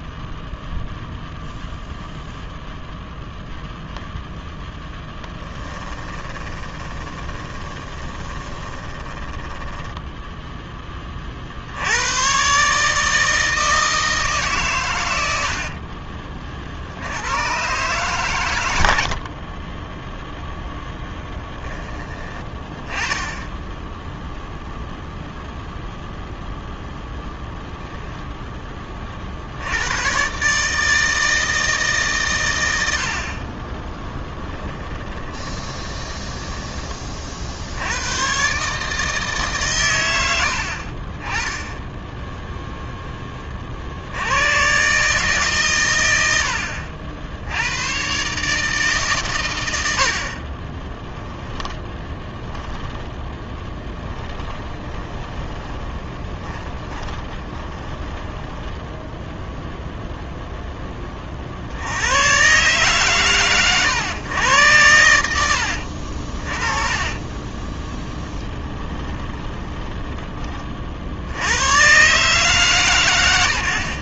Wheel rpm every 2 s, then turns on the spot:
0, 0, 10, 10, 10, 20, 150, 110, 60, 100, 10, 20, 0, 0, 30, 160, 60, 20, 30, 150, 60, 0, 140, 60, 140, 10, 10, 20, 20, 10, 20, 120, 100, 20, 20, 50, 130.
4-10 34-36 50-60 66-70